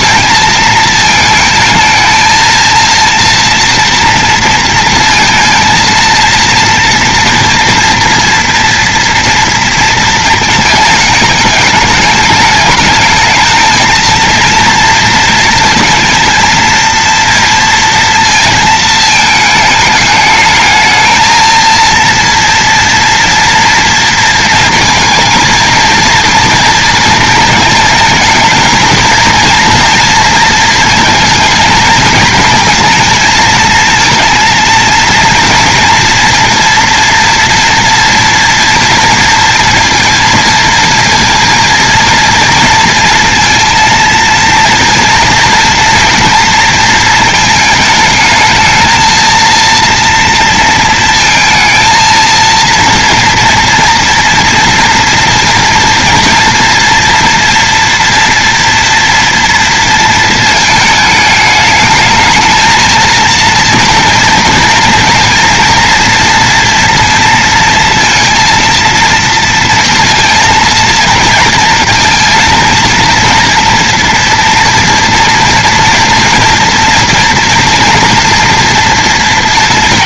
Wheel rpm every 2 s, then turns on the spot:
220, 230, 230, 230, 230, 220, 210, 230, 230, 230, 220, 230, 230, 230, 220, 230, 220, 230, 230, 230, 230, 230, 230, 230, 220, 230, 230, 230, 230, 230, 230, 220, 230, 230, 230, 230, 230, 230, 240, 230.
none